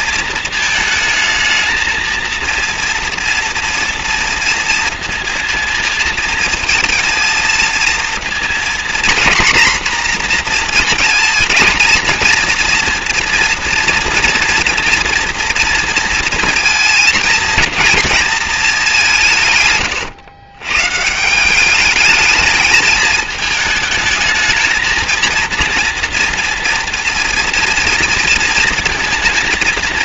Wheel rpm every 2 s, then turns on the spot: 220, 230, 230, 230, 240, 230, 230, 240, 230, 200, 140, 220, 230, 230, 230.
none